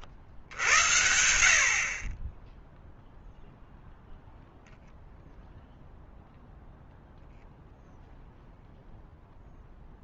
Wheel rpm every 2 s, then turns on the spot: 0, 0, 0, 0, 50.
none